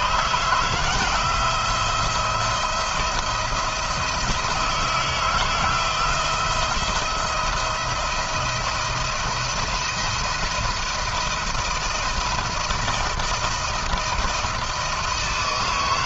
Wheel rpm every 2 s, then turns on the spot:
160, 170, 170, 170, 170, 170, 160, 170.
none